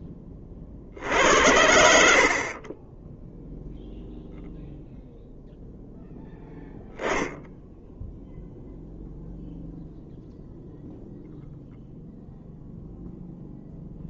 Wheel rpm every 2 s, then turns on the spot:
40, 30, 0, 0, 0, 0, 0.
none